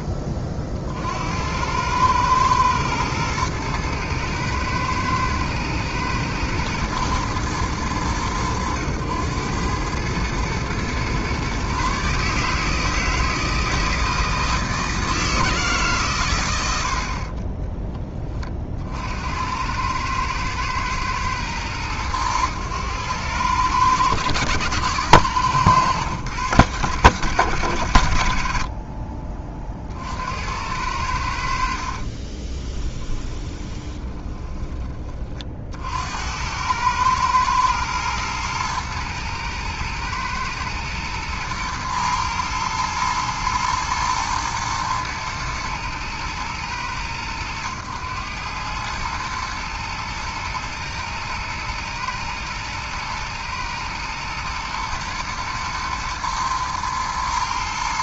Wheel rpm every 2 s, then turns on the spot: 40, 110, 110, 110, 100, 120, 160, 160, 90, 50, 110, 100, 110, 100, 40, 90, 20, 30, 100, 110, 120, 110, 110, 110, 110, 110, 110, 120, 110.
32-34